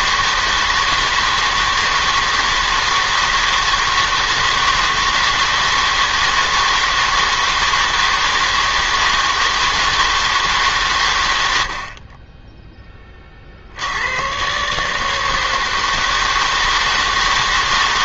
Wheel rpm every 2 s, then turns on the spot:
160, 160, 160, 160, 160, 150, 10, 130, 160.
none